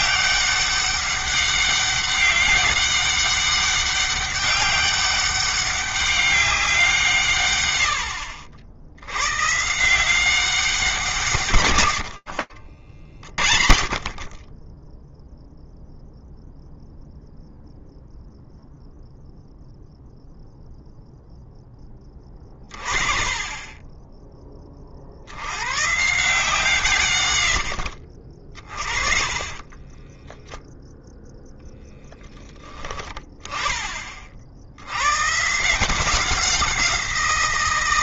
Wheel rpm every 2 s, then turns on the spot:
200, 190, 200, 190, 80, 190, 40, 20, 0, 0, 0, 30, 60, 120, 30, 0, 10, 100, 180.
12-14 28-30